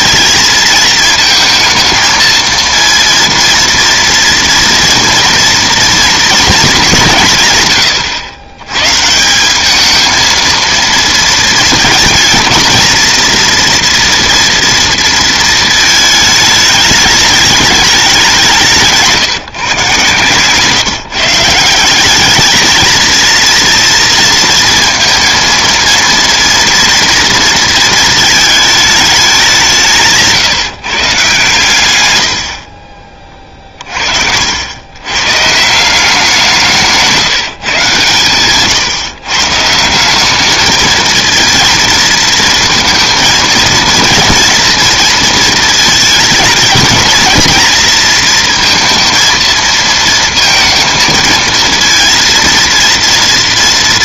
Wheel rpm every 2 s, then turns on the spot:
230, 230, 240, 210, 110, 230, 230, 240, 210, 180, 140, 220, 230, 230, 220, 160, 70, 70, 170, 130, 210, 230, 230, 220, 230, 230, 230.
none